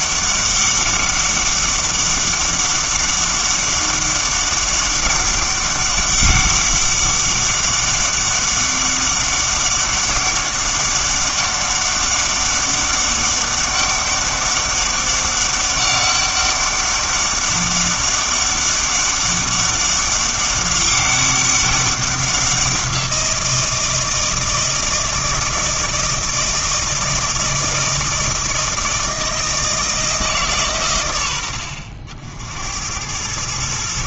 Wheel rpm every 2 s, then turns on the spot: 200, 200, 200, 200, 200, 200, 200, 200, 200, 200, 200, 180, 160, 160, 160, 80, 80.
none